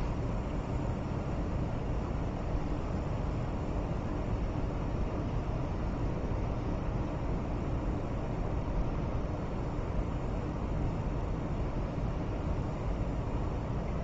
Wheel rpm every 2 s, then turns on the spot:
0, 0, 0, 0, 0, 0, 0.
none